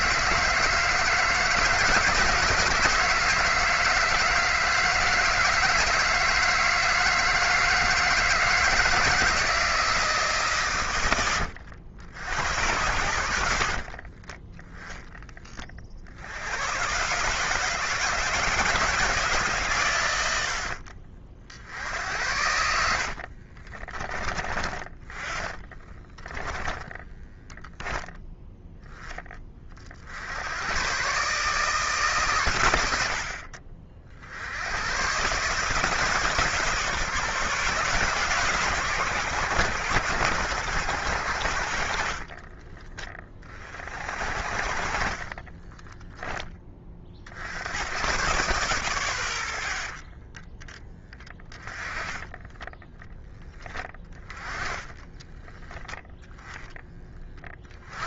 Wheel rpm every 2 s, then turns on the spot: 160, 160, 160, 170, 160, 130, 90, 10, 110, 160, 60, 70, 30, 10, 10, 110, 100, 110, 150, 120, 90, 30, 40, 30, 120, 10, 10, 20, 10.
22-28